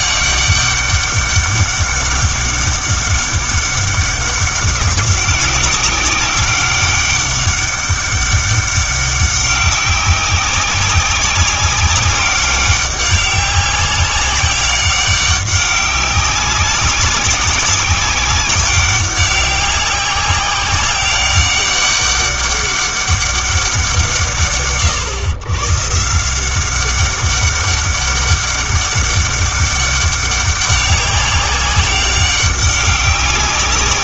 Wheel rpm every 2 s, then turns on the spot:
200, 200, 190, 200, 200, 190, 200, 190, 190, 190, 190, 200, 130, 190, 200, 190, 190.
none